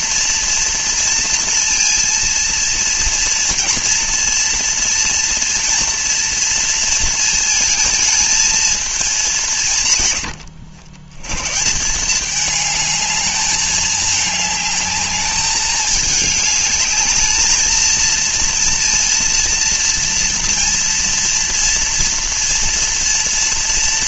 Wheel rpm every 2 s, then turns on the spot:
230, 230, 230, 230, 220, 100, 220, 210, 220, 230, 230, 230.
none